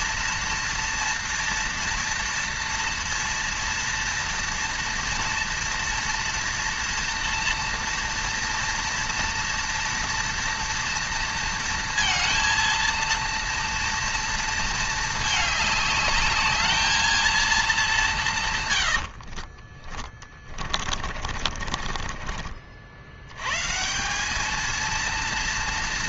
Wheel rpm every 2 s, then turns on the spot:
230, 230, 230, 230, 230, 230, 230, 220, 220, 70, 40, 110, 230.
18-22